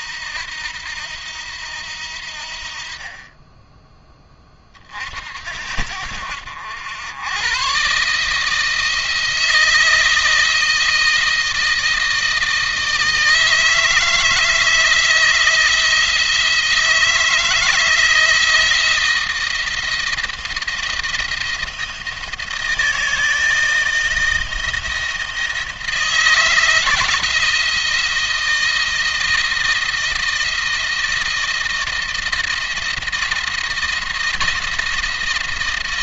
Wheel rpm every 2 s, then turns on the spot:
80, 50, 30, 80, 160, 160, 160, 160, 160, 160, 160, 160, 160, 160, 170, 170, 170, 170.
none